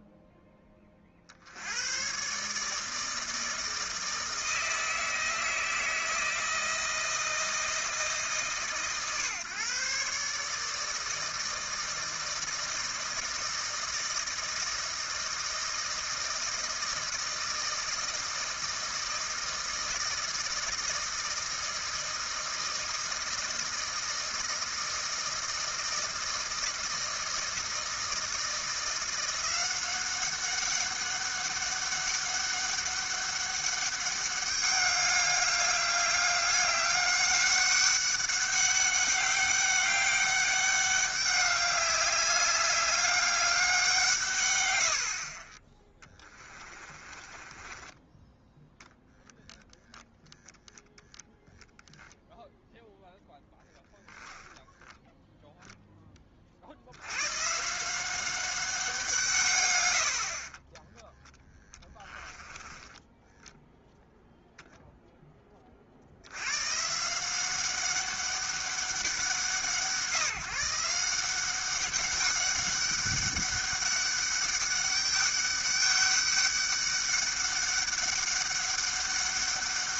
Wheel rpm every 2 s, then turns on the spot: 10, 150, 160, 160, 140, 150, 160, 160, 160, 160, 160, 160, 160, 160, 170, 200, 200, 200, 200, 200, 200, 200, 120, 20, 0, 10, 0, 10, 60, 190, 30, 10, 0, 140, 190, 160, 200, 200, 200, 200.
46-48 54-56 62-64